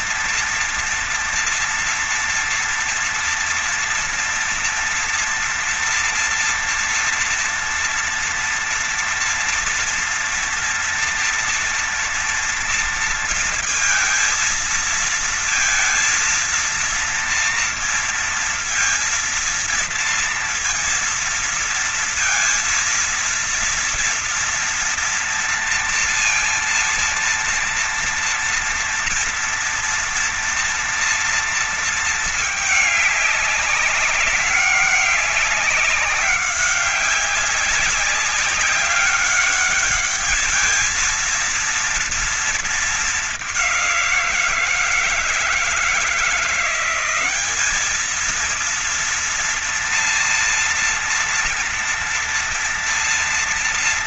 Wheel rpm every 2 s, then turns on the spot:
230, 230, 240, 230, 240, 240, 230, 230, 230, 230, 230, 230, 240, 230, 230, 230, 210, 200, 190, 200, 210, 230, 180, 170, 220, 240, 230.
none